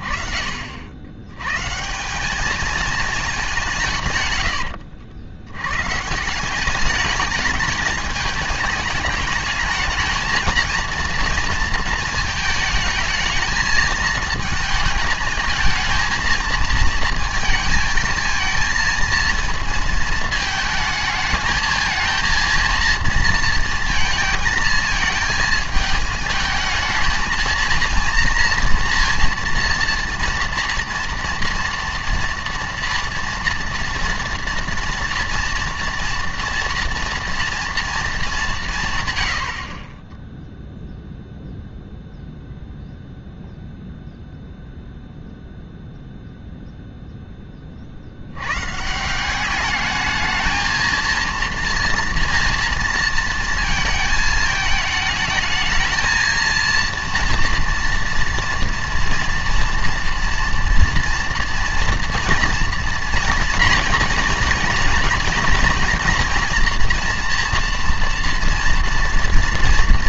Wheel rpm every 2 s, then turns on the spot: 30, 200, 120, 170, 220, 230, 220, 220, 220, 220, 220, 230, 220, 220, 230, 230, 230, 230, 230, 150, 0, 0, 0, 0, 130, 220, 230, 220, 230, 230, 230, 230, 230, 240, 230.
none